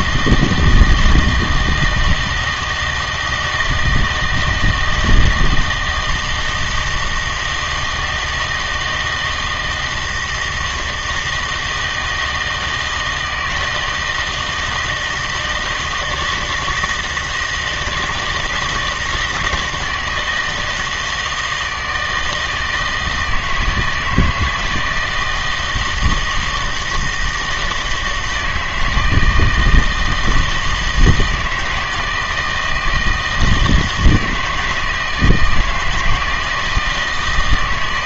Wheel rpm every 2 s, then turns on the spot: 160, 160, 160, 160, 160, 160, 160, 160, 170, 160, 160, 160, 160, 160, 160, 160, 160, 160, 160.
none